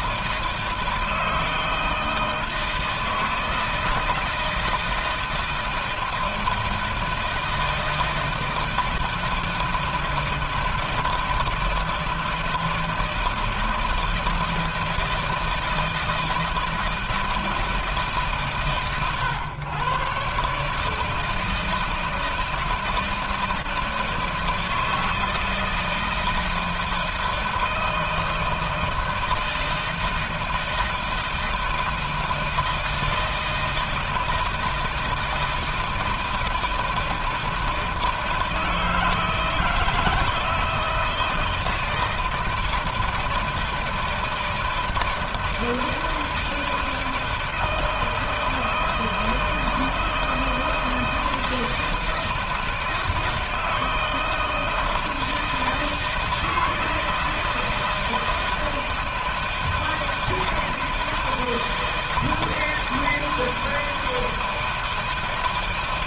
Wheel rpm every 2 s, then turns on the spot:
160, 160, 160, 160, 160, 160, 160, 160, 160, 120, 150, 160, 160, 170, 160, 160, 160, 160, 160, 160, 160, 170, 160, 160, 160, 160, 160, 160, 160, 160, 160, 160, 160.
none